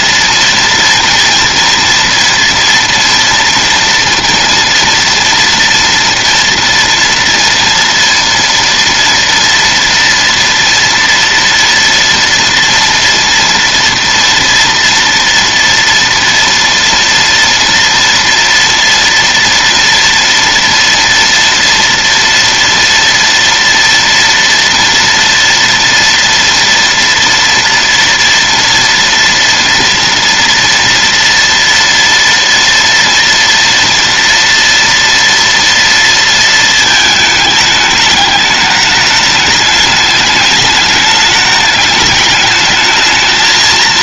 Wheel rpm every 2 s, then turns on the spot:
230, 230, 230, 230, 230, 230, 230, 230, 230, 230, 240, 230, 230, 230, 230, 230, 230, 230, 220, 210, 210, 210.
none